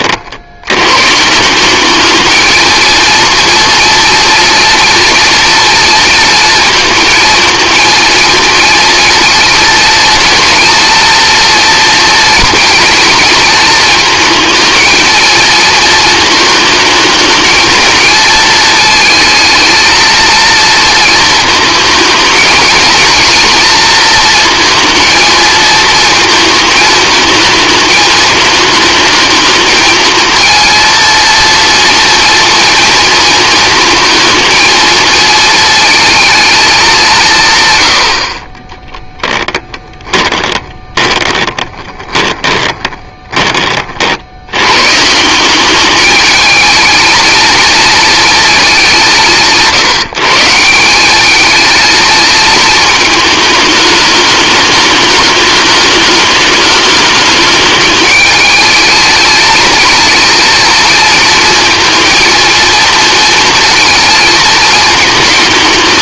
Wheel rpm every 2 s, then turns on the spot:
120, 230, 230, 230, 230, 230, 230, 230, 220, 220, 230, 220, 230, 220, 220, 230, 230, 230, 190, 20, 20, 20, 140, 220, 190, 180, 220, 210, 210, 220, 230, 230, 220.
38-44